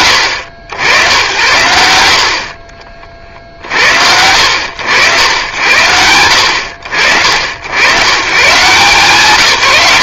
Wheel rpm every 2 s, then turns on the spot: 100, 10, 70, 70, 140.
none